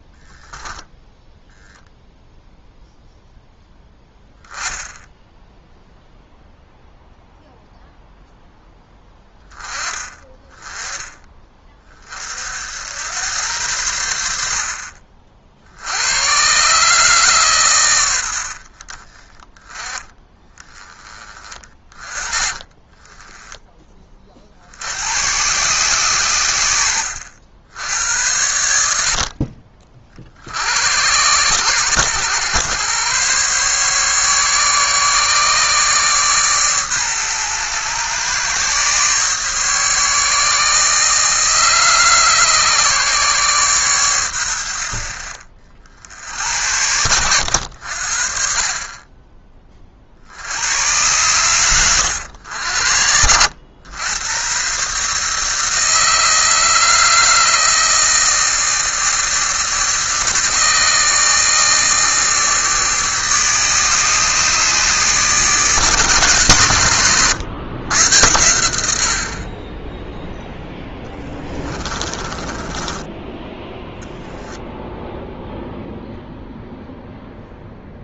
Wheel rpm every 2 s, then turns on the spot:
10, 0, 10, 0, 10, 20, 80, 60, 140, 30, 20, 20, 70, 80, 70, 80, 110, 140, 130, 130, 150, 140, 70, 90, 40, 100, 80, 130, 160, 160, 150, 150, 140, 110, 80, 10, 10, 0, 0.
26-28 52-54 70-74